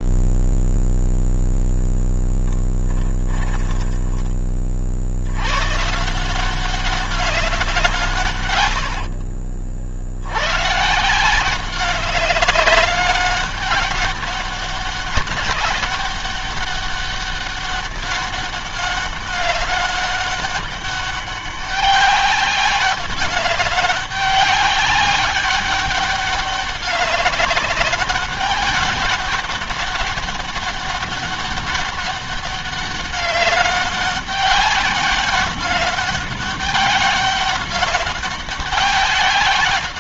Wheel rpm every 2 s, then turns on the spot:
0, 10, 30, 180, 100, 120, 200, 200, 200, 200, 200, 200, 190, 200, 200, 200, 200, 200, 200, 190.
2-4 8-10